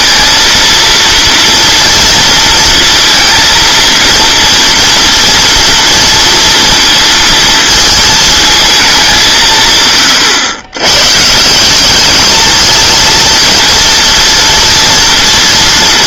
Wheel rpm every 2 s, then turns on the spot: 230, 230, 230, 230, 220, 120, 220, 230.
none